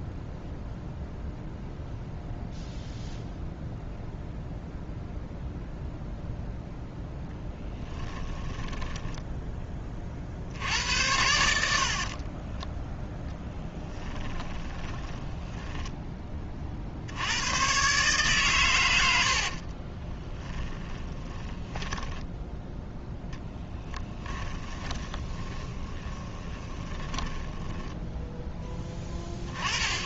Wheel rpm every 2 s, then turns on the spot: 0, 0, 0, 0, 10, 80, 10, 10, 50, 110, 20, 0, 20, 10, 10.
8-10 14-16 20-22 24-28